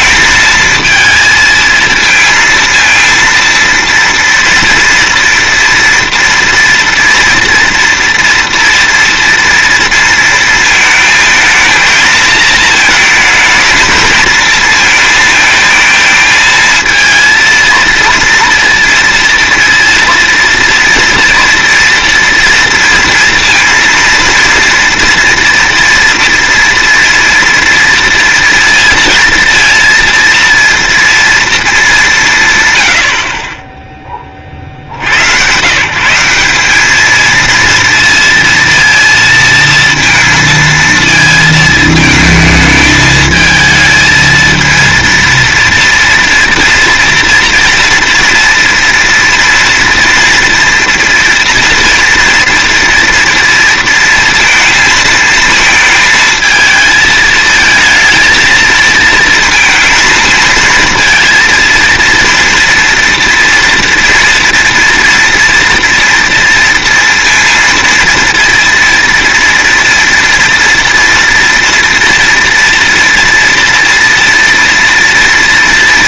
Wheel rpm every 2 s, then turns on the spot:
220, 220, 230, 230, 230, 230, 220, 220, 220, 230, 230, 230, 230, 240, 230, 230, 160, 40, 180, 230, 230, 220, 220, 240, 230, 230, 240, 230, 220, 220, 230, 230, 230, 230, 230, 230, 230, 230.
none